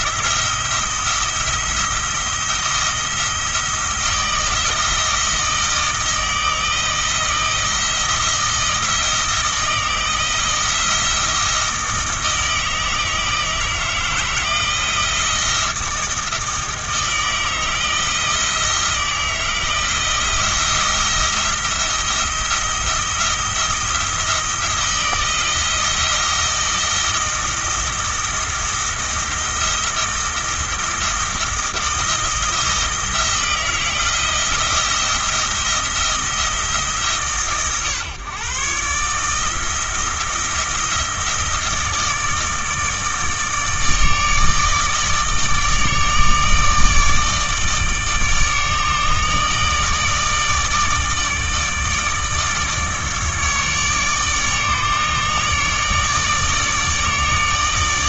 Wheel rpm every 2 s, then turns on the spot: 170, 170, 160, 160, 160, 170, 160, 160, 160, 160, 170, 170, 170, 170, 170, 170, 160, 170, 160, 140, 160, 160, 150, 150, 150, 160, 150, 150, 150.
none